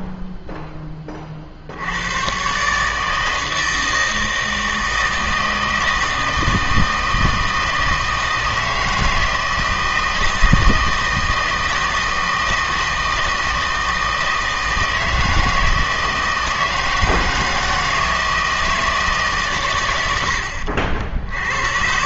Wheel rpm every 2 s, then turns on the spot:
10, 140, 160, 160, 160, 160, 160, 160, 160, 160, 70.
none